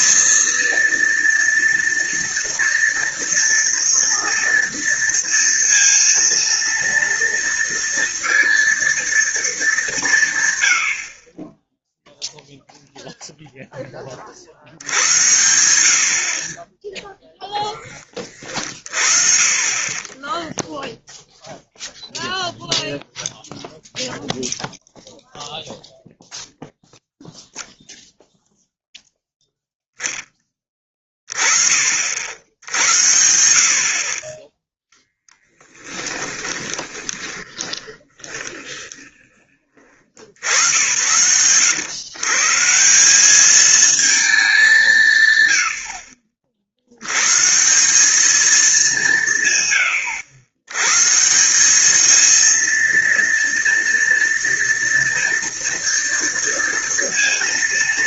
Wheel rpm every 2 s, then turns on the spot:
230, 230, 230, 230, 230, 100, 0, 70, 20, 40, 0, 0, 0, 0, 0, 20, 80, 20, 20, 20, 90, 160, 180, 60, 200, 110, 230, 230, 230.
34-40